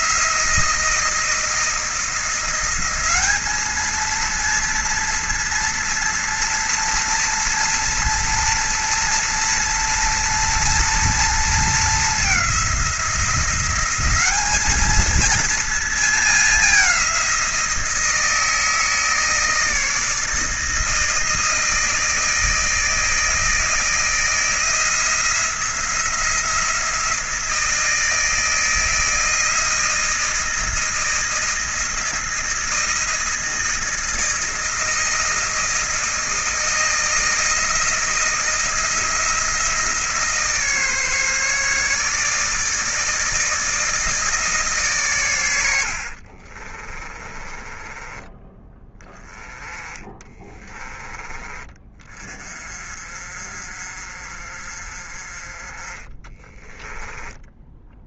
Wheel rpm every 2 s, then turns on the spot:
170, 190, 230, 240, 240, 230, 180, 220, 190, 160, 160, 160, 170, 170, 160, 170, 160, 160, 160, 160, 150, 160, 140, 30, 20, 20, 40, 40, 10.
46-48 56-58